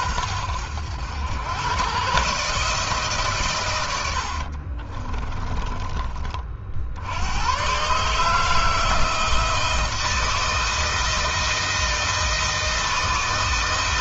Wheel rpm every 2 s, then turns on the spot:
90, 150, 40, 60, 160, 160, 160.
4-6